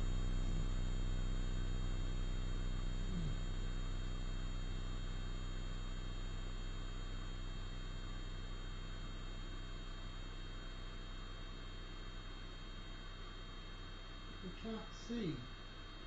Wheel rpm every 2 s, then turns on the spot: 0, 0, 0, 0, 0, 0, 0, 0.
none